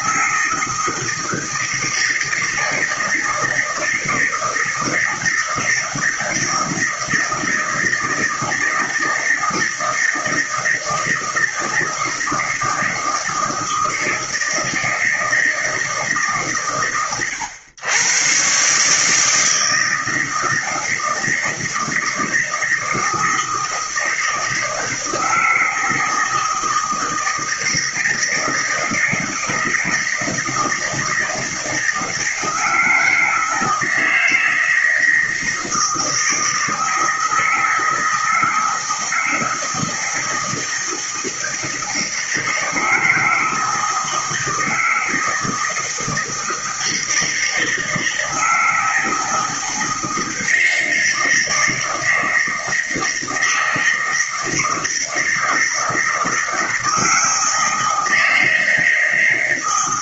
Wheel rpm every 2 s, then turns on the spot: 160, 160, 160, 160, 160, 160, 170, 160, 110, 140, 160, 160, 160, 160, 160, 160, 160, 160, 160, 160, 160, 160, 160, 160, 160, 160, 160, 160, 160, 160.
none